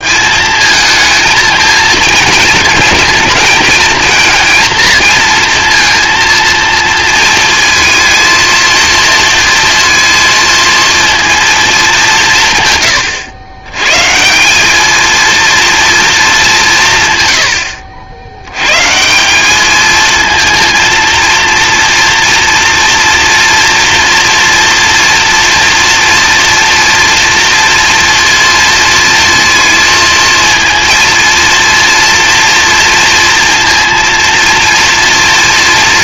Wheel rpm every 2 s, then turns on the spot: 220, 220, 220, 230, 230, 230, 130, 200, 180, 110, 230, 240, 240, 230, 230, 230, 240, 230.
none